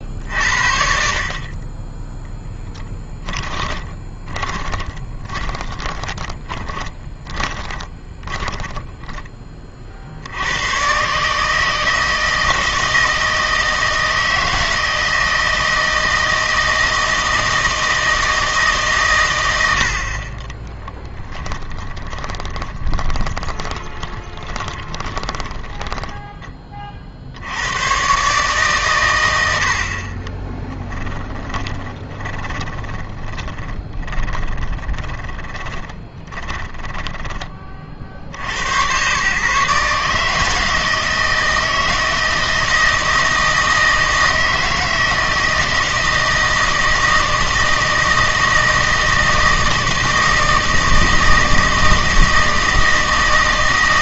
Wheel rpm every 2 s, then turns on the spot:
60, 10, 20, 20, 10, 120, 160, 160, 160, 140, 10, 20, 20, 30, 130, 10, 20, 20, 10, 100, 160, 160, 160, 160, 160, 160, 160.
2-10 20-26 30-38